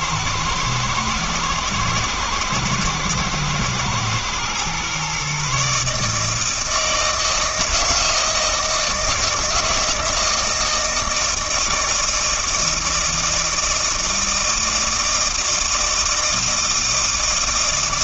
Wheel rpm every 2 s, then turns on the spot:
120, 110, 120, 160, 160, 160, 160, 160, 160.
none